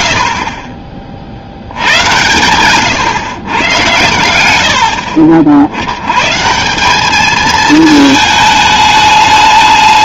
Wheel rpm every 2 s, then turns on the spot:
30, 120, 80, 160, 210.
none